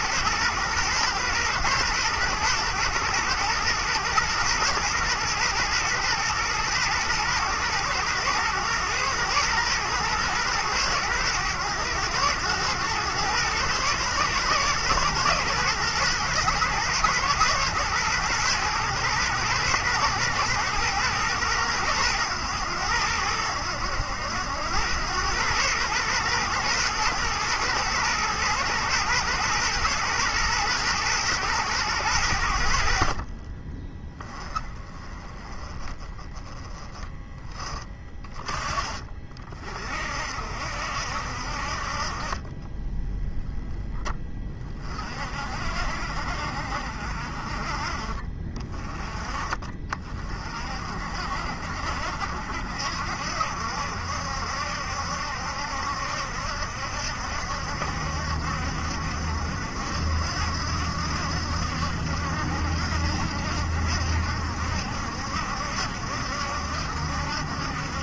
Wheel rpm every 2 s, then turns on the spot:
120, 110, 120, 110, 110, 110, 110, 110, 110, 110, 120, 100, 90, 120, 120, 120, 70, 20, 10, 30, 60, 20, 30, 50, 30, 40, 60, 70, 70, 60, 70, 70, 70, 70.
42-44